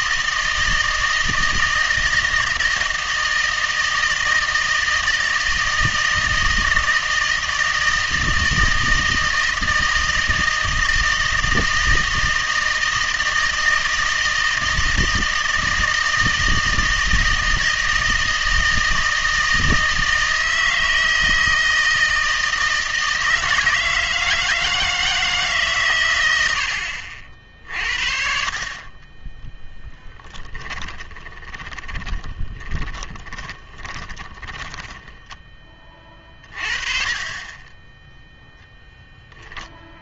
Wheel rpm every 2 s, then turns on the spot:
160, 160, 160, 160, 160, 160, 160, 160, 160, 160, 160, 160, 160, 90, 40, 20, 20, 10, 40, 0.
30-36